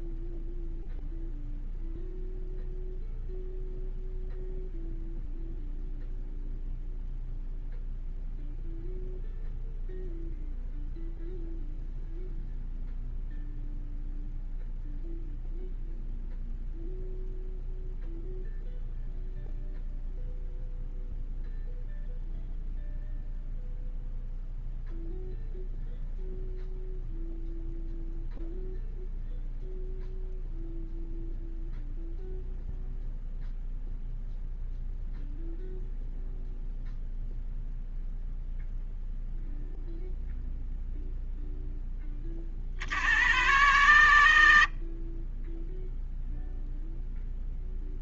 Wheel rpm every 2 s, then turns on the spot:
0, 0, 0, 0, 0, 0, 0, 0, 0, 0, 0, 0, 0, 0, 0, 0, 0, 0, 0, 0, 0, 40, 20, 0.
none